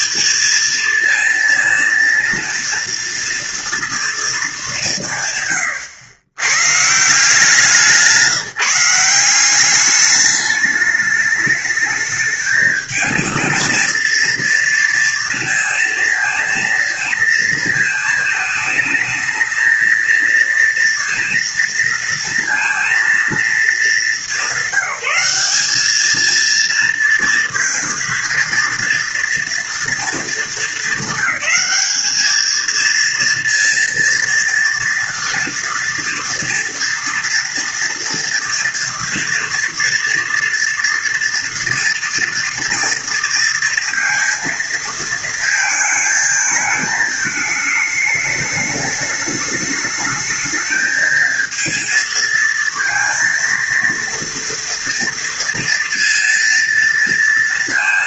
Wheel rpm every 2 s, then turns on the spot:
230, 230, 170, 150, 180, 210, 220, 230, 230, 220, 230, 230, 180, 230, 230, 220, 230, 230, 230, 230, 230, 230, 230, 220, 210, 220, 230, 230, 230.
none